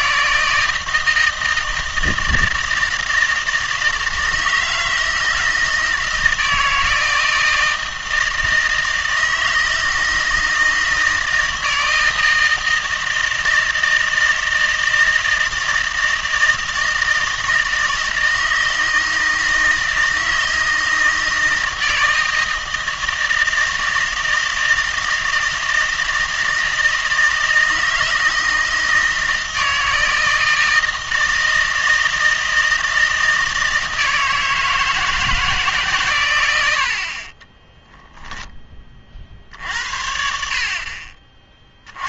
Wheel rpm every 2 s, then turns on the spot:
160, 160, 160, 160, 160, 160, 160, 160, 160, 160, 160, 160, 160, 160, 160, 160, 160, 160, 80, 20, 40.
none